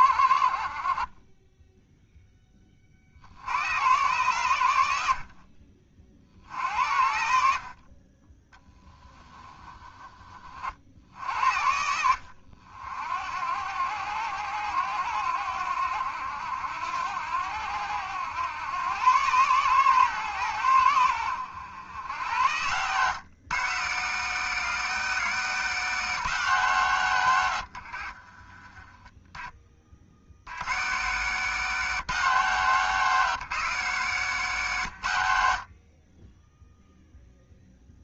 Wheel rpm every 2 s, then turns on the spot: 40, 30, 90, 70, 10, 50, 60, 90, 80, 110, 100, 110, 170, 140, 30, 100, 160, 130, 0.
8-10